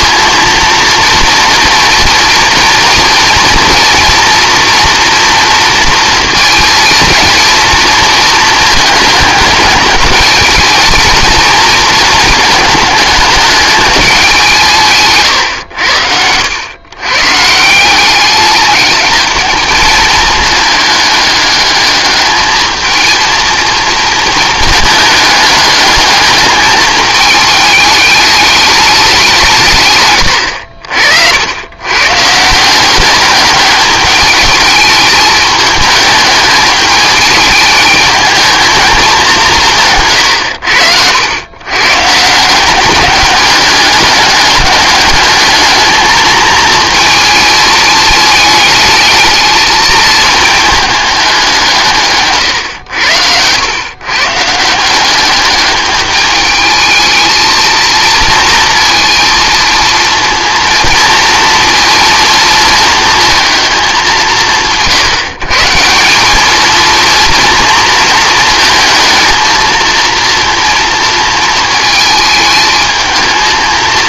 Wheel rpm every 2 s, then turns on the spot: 230, 230, 230, 230, 220, 220, 220, 180, 110, 210, 210, 220, 220, 210, 210, 70, 170, 210, 210, 220, 90, 170, 210, 220, 210, 210, 120, 160, 210, 230, 230, 230, 160, 210, 220, 230, 220.
none